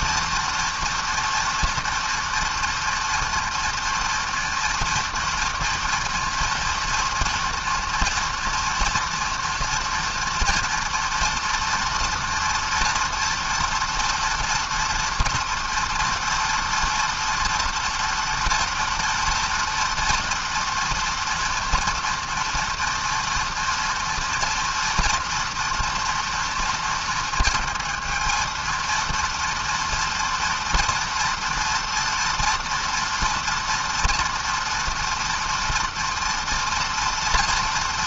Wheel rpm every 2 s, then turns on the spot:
230, 230, 230, 230, 230, 230, 240, 230, 230, 230, 240, 230, 230, 230, 230, 240, 230, 230, 230.
none